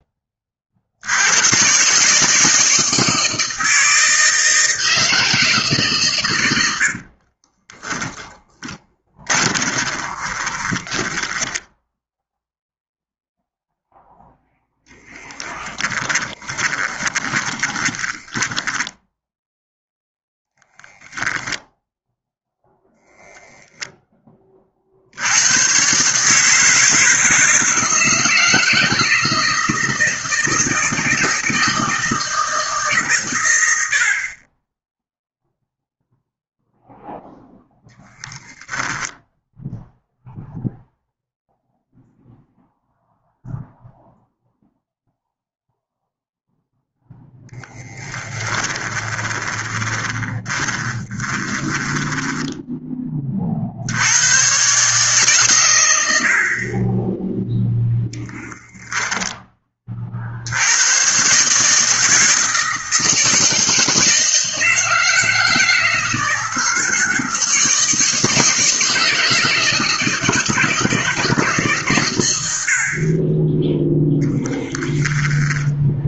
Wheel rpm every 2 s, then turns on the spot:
70, 160, 160, 70, 20, 10, 0, 0, 20, 10, 0, 0, 60, 160, 160, 160, 140, 10, 0, 0, 0, 0, 0, 0, 20, 20, 20, 140, 30, 10, 100, 160, 160, 160, 160, 160, 50, 10.
6-12 16-20 48-52 74-76